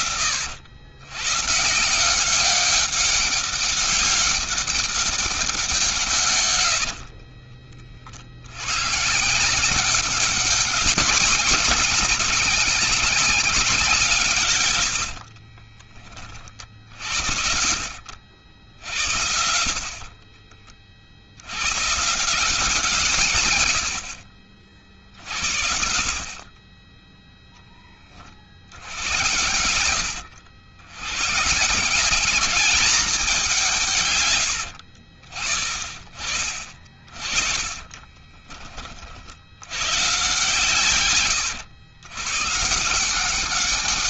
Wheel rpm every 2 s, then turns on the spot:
90, 190, 200, 70, 130, 210, 200, 80, 50, 60, 50, 160, 60, 30, 70, 100, 210, 90, 40, 40, 120, 120.
6-8 14-16 34-40